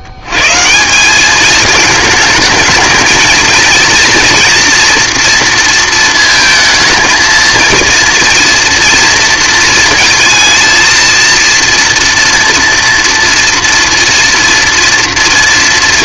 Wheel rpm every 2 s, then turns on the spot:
140, 220, 230, 220, 230, 230, 230, 230.
none